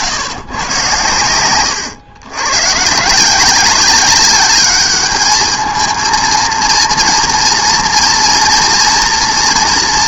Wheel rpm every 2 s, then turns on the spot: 130, 120, 200, 230, 230.
none